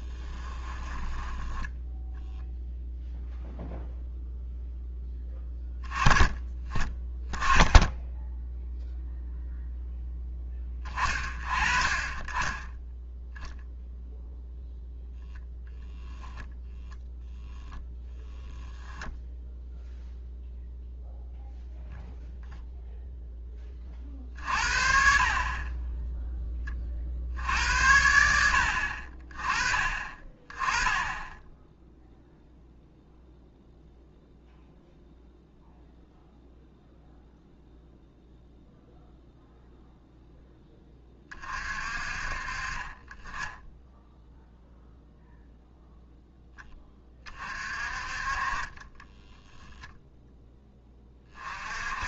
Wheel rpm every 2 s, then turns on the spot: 10, 0, 10, 10, 0, 30, 0, 0, 10, 0, 0, 20, 20, 80, 30, 10, 0, 0, 0, 0, 40, 10, 0, 30, 10, 30.
0-2 48-50